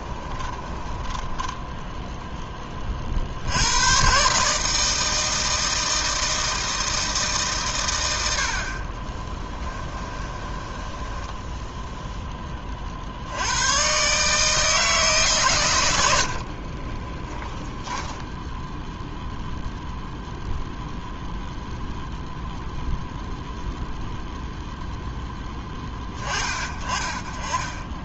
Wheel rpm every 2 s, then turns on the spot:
10, 20, 150, 160, 30, 10, 40, 150, 20, 0, 0, 0, 0, 20.
0-2 8-12 16-18